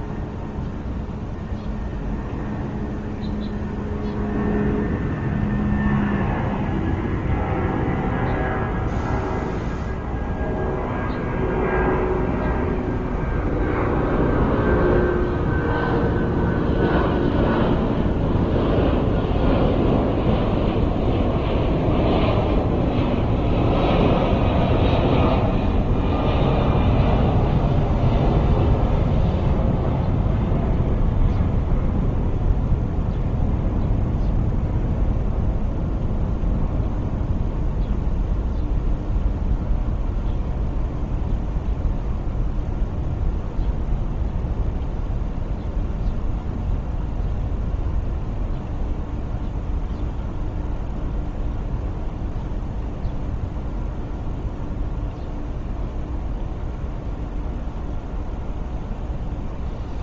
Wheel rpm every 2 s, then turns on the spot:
0, 0, 0, 0, 0, 0, 0, 0, 0, 0, 0, 0, 0, 0, 0, 0, 0, 0, 0, 0, 0, 0, 0, 0, 0, 0, 0, 0, 0, 0.
none